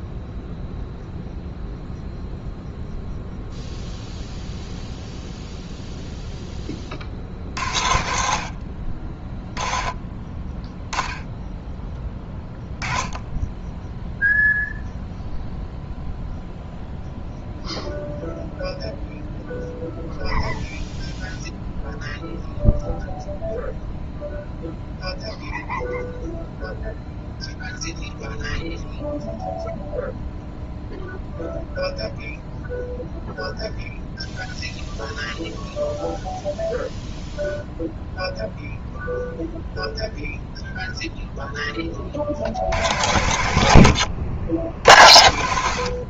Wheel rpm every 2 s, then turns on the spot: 0, 0, 0, 0, 70, 10, 10, 0, 0, 0, 0, 0, 0, 0, 0, 0, 0, 0, 0, 0, 0, 80, 80.
none